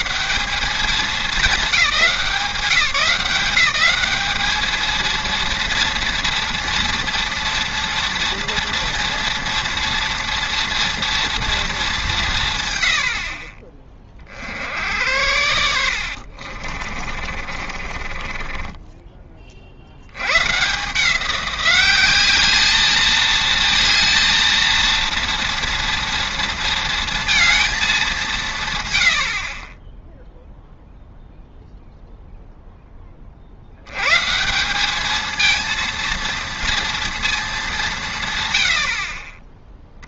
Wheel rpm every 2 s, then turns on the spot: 150, 170, 210, 230, 230, 230, 120, 70, 50, 20, 140, 210, 230, 230, 140, 0, 0, 180, 230, 80.
16-18